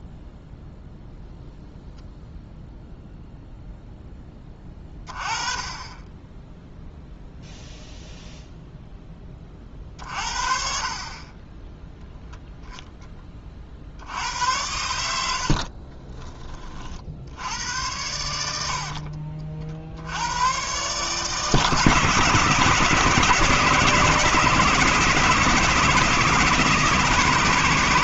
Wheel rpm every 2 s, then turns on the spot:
0, 0, 20, 0, 0, 40, 10, 90, 50, 60, 130, 160, 160, 160.
none